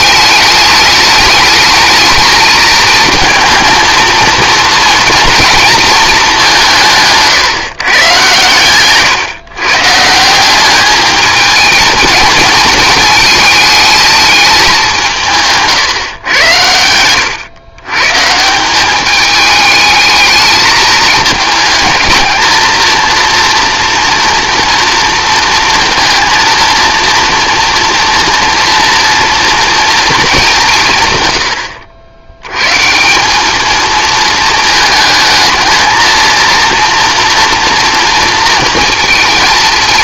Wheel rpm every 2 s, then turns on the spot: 210, 220, 230, 180, 130, 200, 220, 190, 100, 190, 220, 220, 230, 230, 230, 180, 140, 220, 230, 230.
16-18